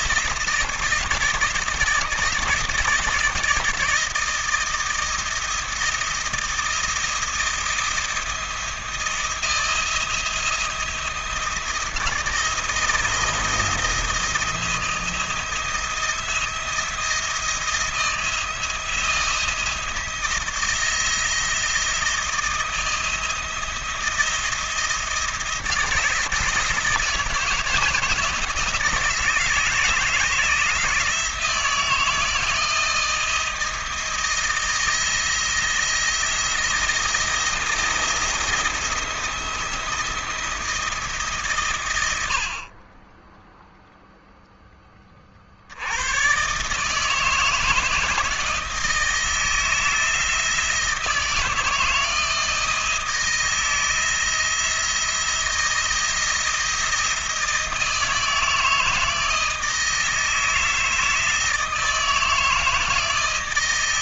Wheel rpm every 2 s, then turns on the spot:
170, 160, 160, 170, 170, 170, 170, 160, 170, 170, 170, 160, 160, 160, 160, 160, 160, 160, 170, 170, 170, 50, 10, 140, 160, 160, 160, 170, 170, 160, 160, 160.
none